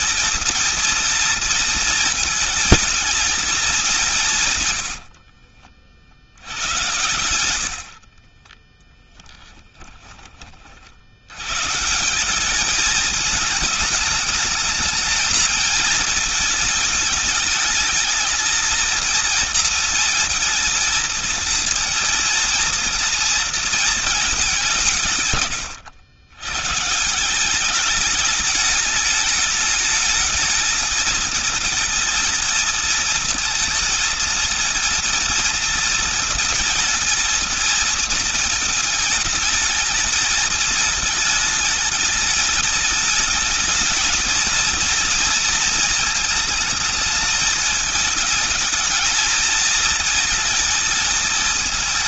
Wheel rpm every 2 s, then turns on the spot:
220, 220, 120, 110, 20, 50, 210, 220, 220, 230, 220, 230, 180, 140, 220, 220, 230, 230, 230, 220, 220, 210, 230, 220, 220, 220.
4-10